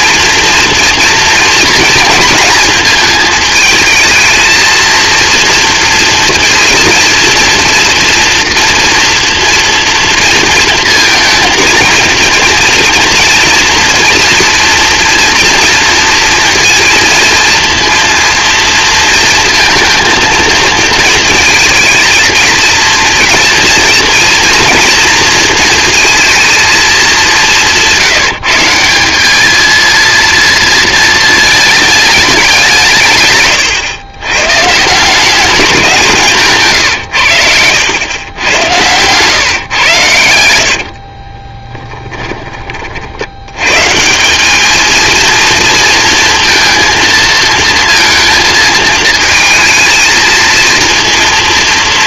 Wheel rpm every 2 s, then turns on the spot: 230, 230, 230, 230, 230, 230, 230, 230, 230, 230, 220, 230, 230, 210, 190, 220, 140, 170, 120, 110, 50, 50, 220, 230, 220, 230.
40-42